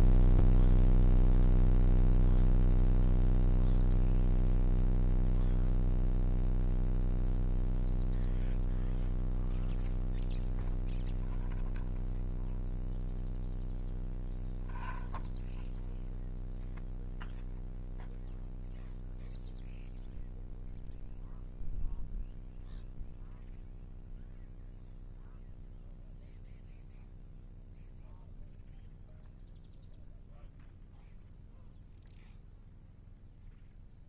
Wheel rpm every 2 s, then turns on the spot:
0, 0, 0, 0, 0, 0, 0, 0, 0, 0, 0, 0, 0, 0, 0, 0, 0.
none